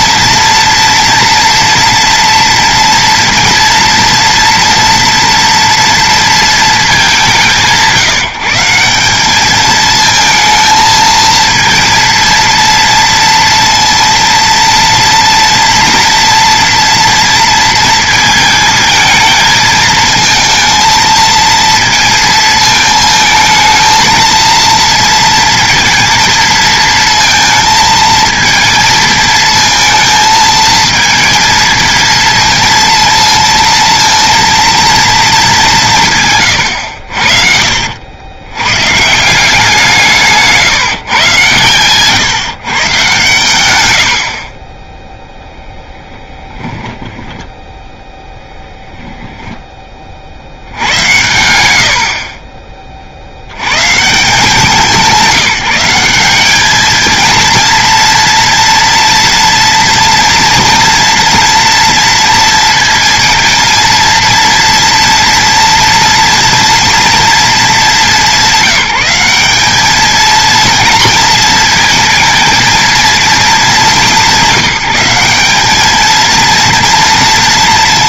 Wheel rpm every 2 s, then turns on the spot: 230, 230, 230, 220, 170, 220, 230, 230, 230, 220, 220, 220, 230, 230, 220, 220, 230, 230, 120, 100, 160, 140, 30, 20, 0, 80, 40, 190, 200, 230, 230, 230, 230, 230, 200, 230, 220, 190, 220.
36-38 44-48